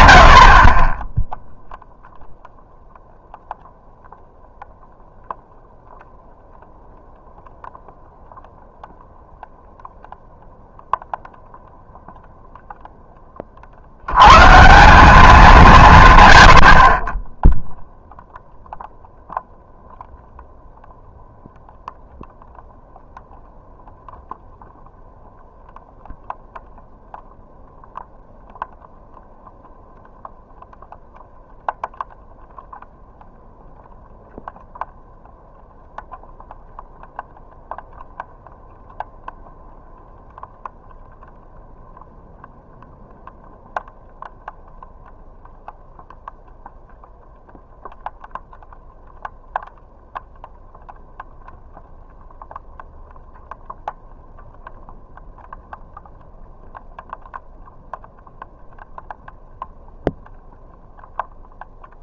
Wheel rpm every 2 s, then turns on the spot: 40, 0, 0, 0, 0, 0, 0, 160, 60, 0, 0, 0, 0, 0, 0, 0, 0, 0, 0, 0, 0, 0, 0, 0, 0, 0, 0, 0, 0, 0, 0.
none